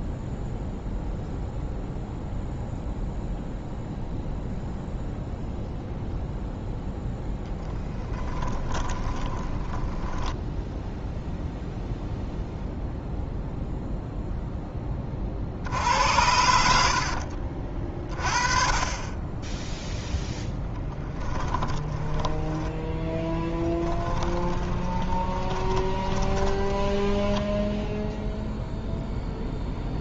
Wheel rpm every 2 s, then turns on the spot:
0, 0, 0, 0, 20, 0, 0, 20, 70, 30, 10, 10, 20, 20, 0.
8-10 16-18 20-28